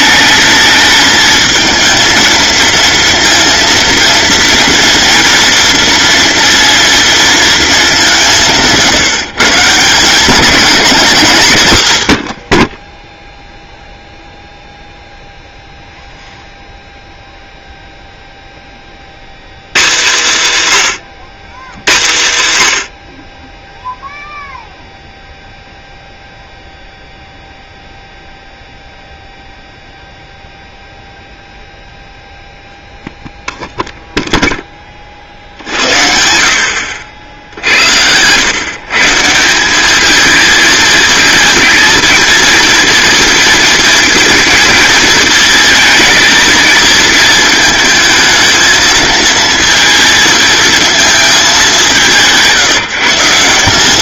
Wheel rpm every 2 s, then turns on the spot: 220, 230, 240, 230, 170, 190, 20, 0, 0, 40, 160, 90, 0, 0, 0, 0, 0, 30, 60, 140, 220, 230, 230, 220, 220, 230, 170.
none